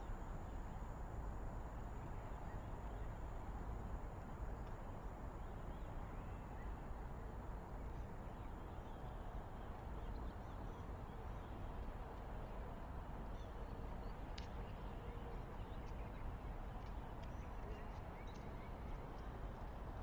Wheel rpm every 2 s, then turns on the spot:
0, 0, 0, 0, 0, 0, 0, 0, 0, 0.
none